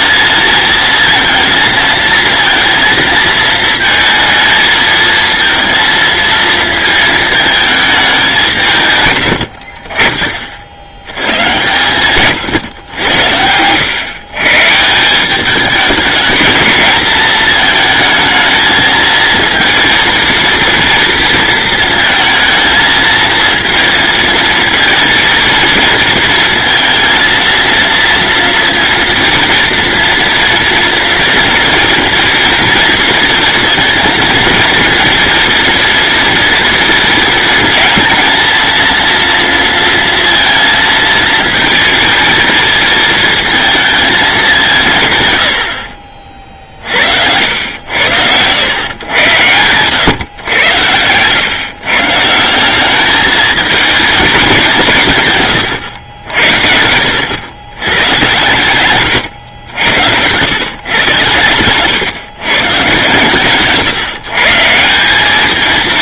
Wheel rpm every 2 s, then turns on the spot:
230, 230, 220, 220, 130, 90, 100, 160, 220, 220, 230, 230, 230, 230, 230, 230, 230, 230, 230, 230, 230, 220, 160, 60, 100, 110, 200, 170, 80, 120, 110, 130, 160.
58-60